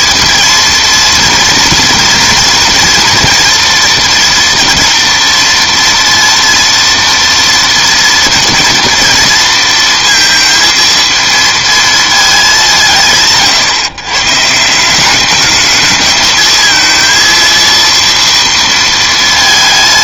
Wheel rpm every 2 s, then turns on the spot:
230, 230, 230, 230, 240, 230, 180, 170, 220, 230.
none